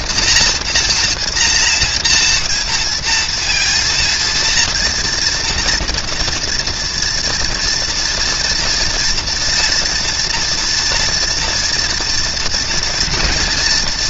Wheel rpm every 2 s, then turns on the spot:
240, 230, 240, 230, 230, 230, 230.
none